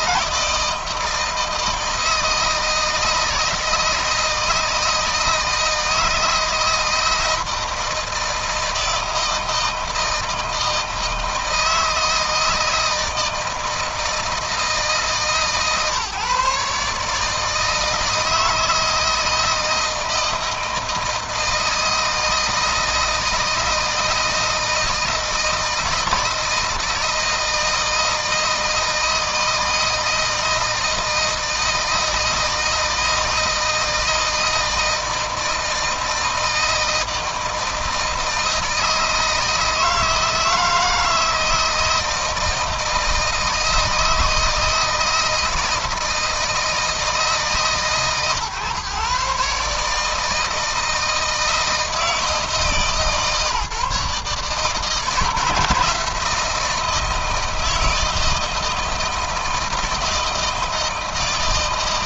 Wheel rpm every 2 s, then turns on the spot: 160, 160, 160, 160, 160, 160, 160, 160, 150, 160, 160, 160, 160, 160, 160, 160, 160, 160, 160, 160, 160, 160, 160, 160, 130, 160, 140, 150, 160, 160, 160.
none